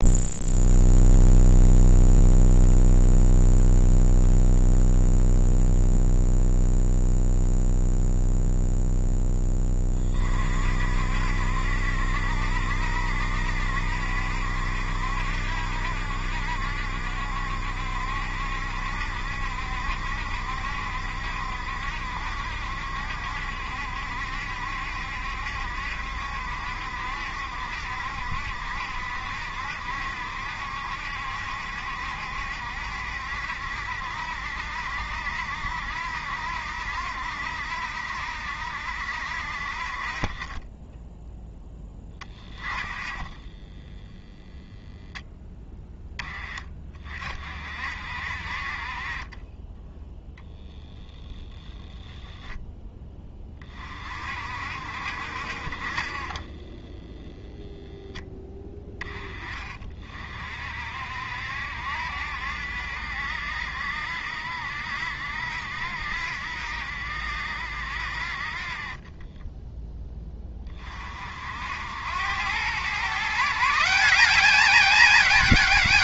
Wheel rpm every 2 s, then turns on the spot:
0, 0, 0, 0, 0, 50, 70, 70, 70, 70, 70, 70, 70, 70, 70, 70, 70, 60, 70, 70, 20, 20, 0, 30, 40, 0, 10, 60, 10, 10, 60, 70, 70, 70, 30, 30, 120, 210.
none